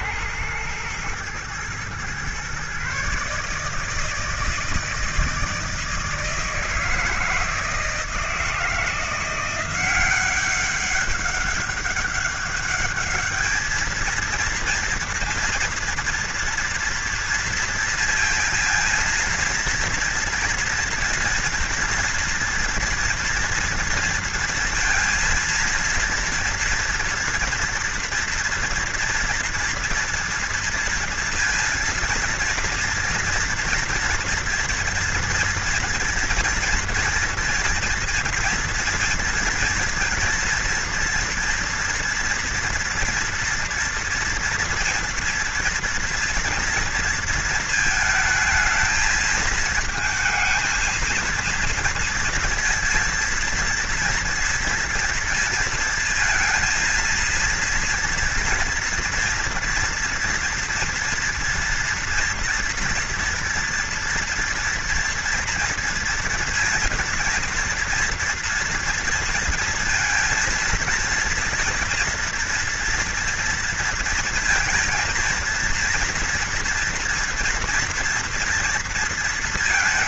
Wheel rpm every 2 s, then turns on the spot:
110, 130, 160, 160, 160, 190, 200, 230, 230, 230, 230, 240, 230, 230, 230, 230, 230, 230, 230, 230, 230, 230, 230, 230, 220, 220, 230, 230, 230, 230, 230, 230, 230, 230, 230, 230, 230, 230, 230, 230.
none